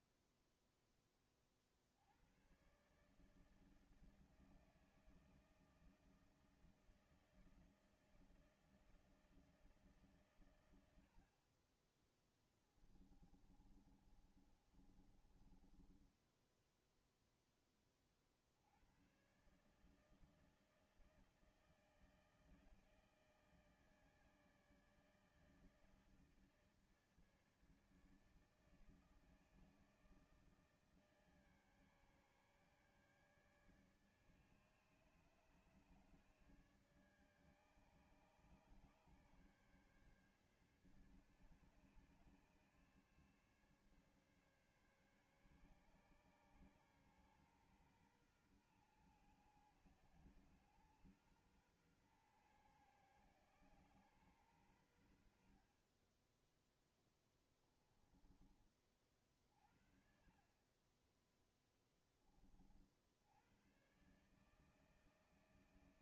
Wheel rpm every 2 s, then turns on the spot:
10, 120, 160, 160, 160, 110, 10, 30, 10, 70, 160, 160, 160, 150, 160, 160, 140, 150, 150, 150, 140, 140, 140, 140, 120, 120, 130, 110, 10, 30, 30, 30, 150.
12-18